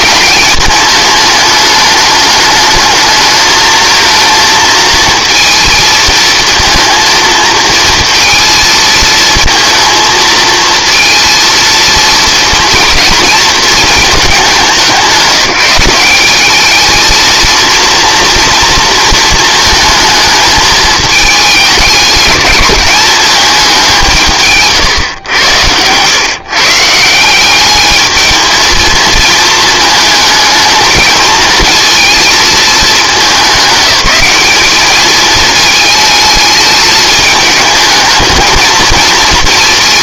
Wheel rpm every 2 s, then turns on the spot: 210, 210, 230, 230, 220, 230, 230, 190, 210, 230, 220, 210, 140, 150, 220, 220, 210, 210, 210, 220.
none